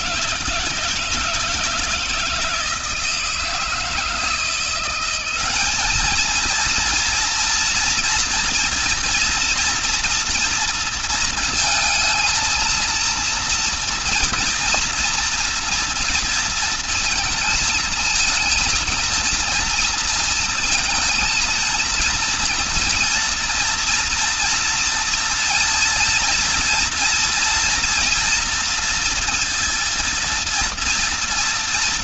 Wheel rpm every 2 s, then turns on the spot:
160, 160, 170, 220, 240, 230, 230, 230, 230, 230, 230, 230, 230, 230, 230, 230.
none